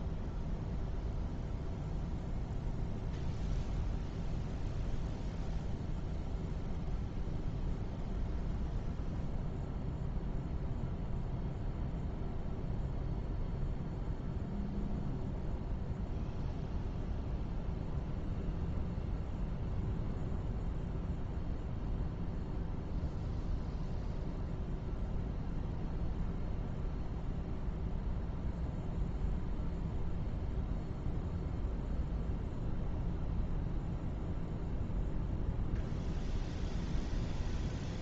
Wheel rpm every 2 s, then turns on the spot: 0, 0, 0, 0, 0, 0, 0, 0, 0, 0, 0, 0, 0, 0, 0, 0, 0, 0, 0.
none